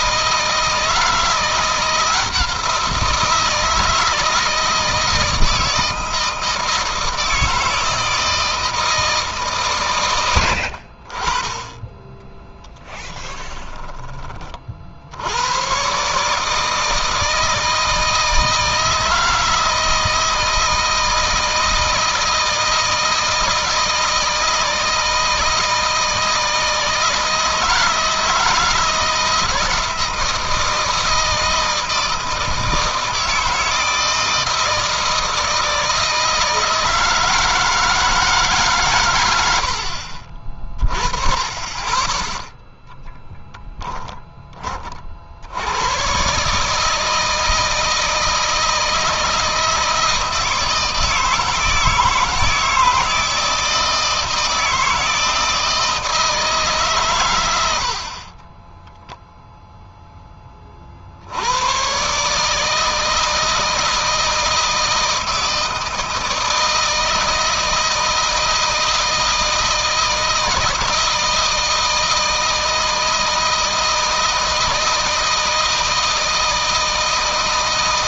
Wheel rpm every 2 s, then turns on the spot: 160, 170, 160, 160, 160, 60, 10, 60, 160, 160, 160, 160, 160, 160, 170, 160, 160, 160, 160, 130, 40, 0, 40, 150, 160, 160, 160, 160, 140, 10, 40, 160, 160, 160, 160, 160, 160, 160, 160.
12-14 58-60